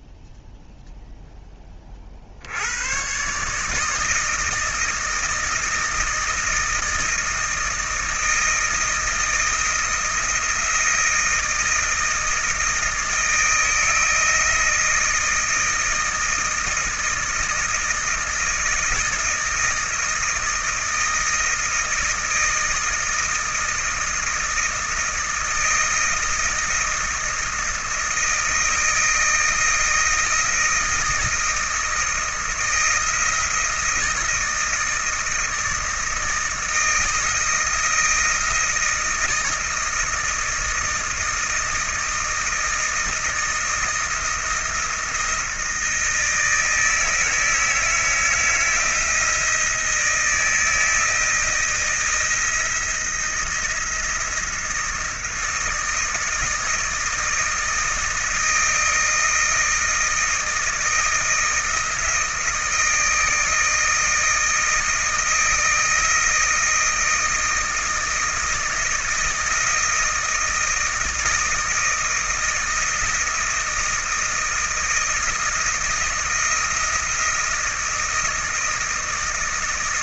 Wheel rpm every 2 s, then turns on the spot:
0, 100, 160, 160, 160, 160, 160, 160, 160, 160, 160, 160, 160, 160, 160, 160, 160, 160, 160, 170, 160, 160, 170, 160, 160, 160, 170, 160, 160, 160, 160, 160, 160, 160, 160, 160, 160, 160, 170, 160.
none